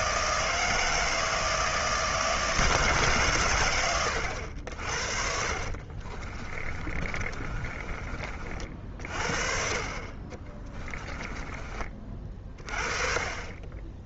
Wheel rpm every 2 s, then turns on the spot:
160, 150, 60, 30, 50, 30, 40.
4-8 10-12